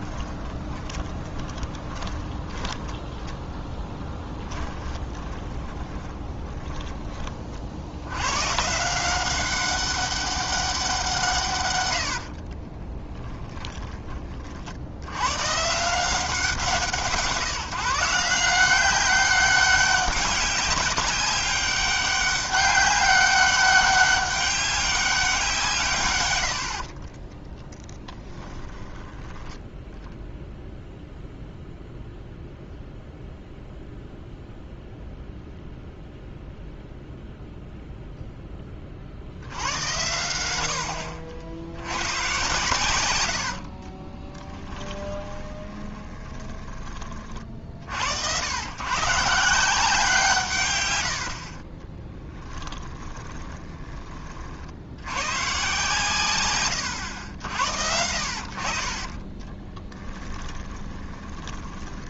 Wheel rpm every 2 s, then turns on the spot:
20, 10, 20, 20, 160, 190, 30, 70, 160, 190, 200, 200, 200, 60, 20, 0, 0, 0, 0, 30, 70, 110, 10, 30, 130, 120, 30, 80, 100, 40, 30.
0-2 4-8 12-14 26-30 44-46 52-54 58-62